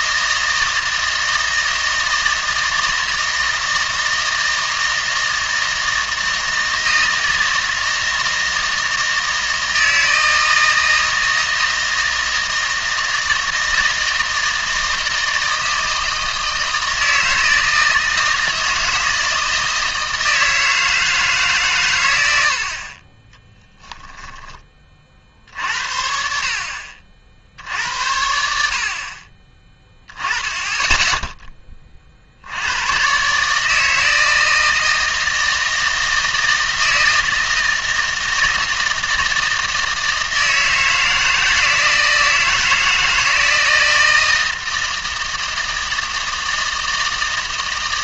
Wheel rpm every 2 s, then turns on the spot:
160, 160, 160, 160, 160, 160, 160, 160, 160, 160, 160, 60, 40, 50, 50, 10, 100, 160, 160, 160, 160, 160, 160, 160.
none